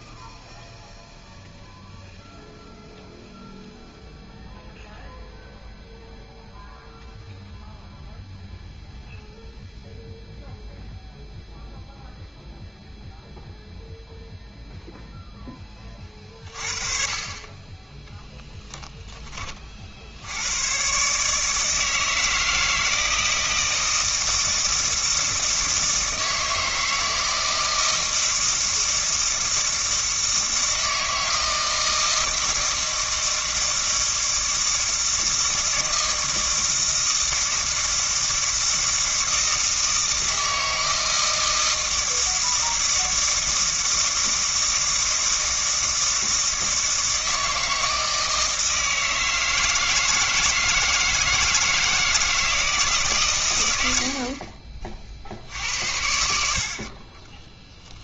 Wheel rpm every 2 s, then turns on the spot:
0, 0, 0, 0, 0, 0, 0, 20, 20, 40, 160, 160, 160, 160, 160, 160, 160, 160, 160, 160, 160, 160, 160, 160, 160, 160, 130, 60, 10.
56-58